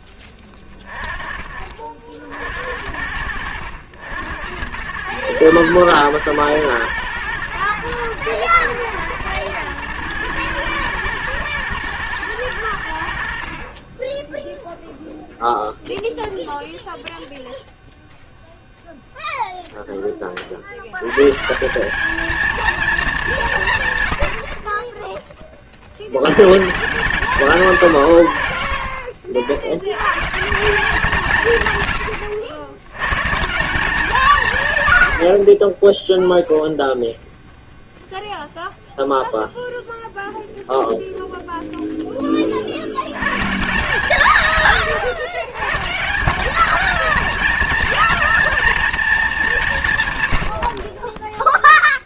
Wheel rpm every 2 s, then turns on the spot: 20, 40, 90, 110, 110, 110, 100, 0, 0, 0, 50, 230, 60, 130, 60, 170, 80, 150, 0, 0, 0, 40, 150, 200, 230, 80.
none